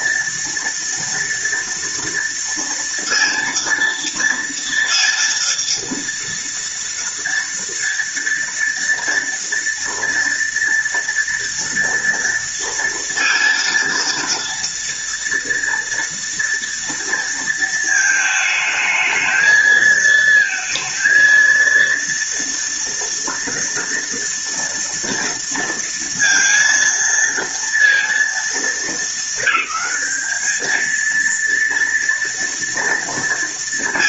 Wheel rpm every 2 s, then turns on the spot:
230, 230, 230, 230, 230, 230, 230, 230, 230, 220, 230, 230, 230, 230, 220, 220, 230.
none